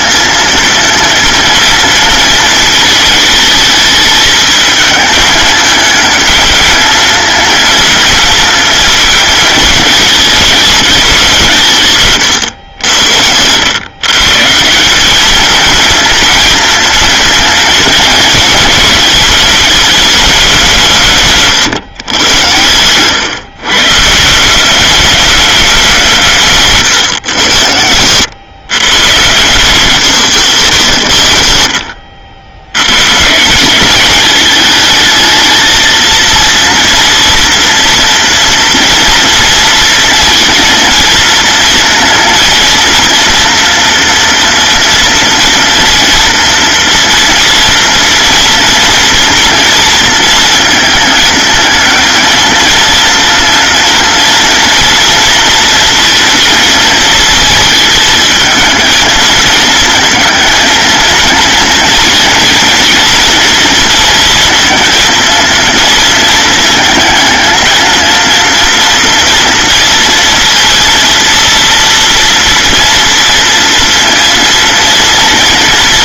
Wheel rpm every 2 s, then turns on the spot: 230, 220, 220, 230, 220, 190, 90, 200, 230, 210, 150, 130, 210, 120, 130, 120, 140, 220, 230, 230, 230, 240, 230, 230, 230, 220, 230, 240, 230, 220, 230, 230, 230, 220, 230, 230, 230, 230.
none